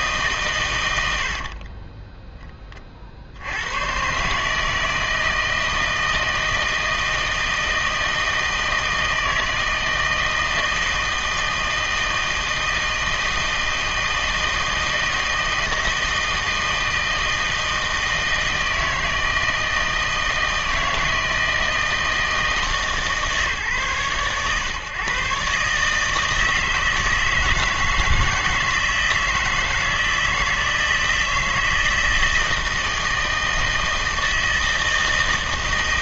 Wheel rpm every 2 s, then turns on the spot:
120, 20, 150, 160, 160, 160, 160, 160, 160, 160, 160, 150, 130, 160, 160, 160, 160, 160.
none